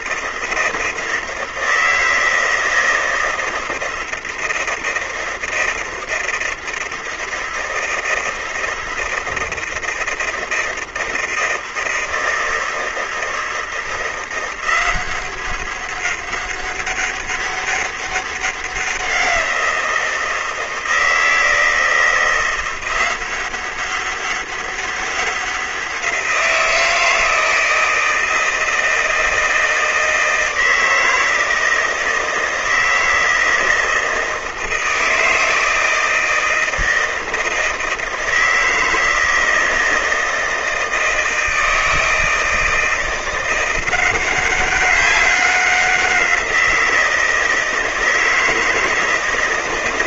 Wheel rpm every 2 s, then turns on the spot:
160, 160, 160, 160, 160, 160, 160, 180, 200, 190, 160, 180, 200, 170, 160, 160, 160, 160, 160, 160, 160, 170, 190, 170, 160.
none